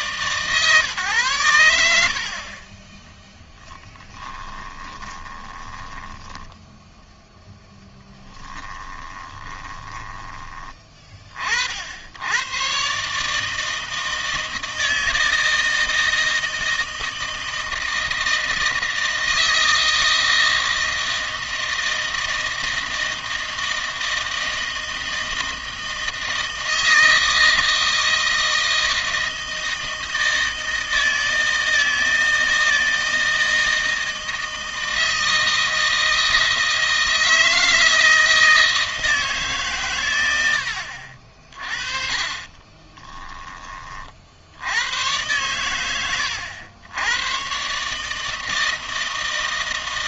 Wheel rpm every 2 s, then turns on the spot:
130, 30, 20, 10, 30, 20, 120, 160, 160, 160, 160, 160, 160, 160, 160, 160, 160, 160, 160, 160, 80, 30, 90, 90, 160.
4-10 42-44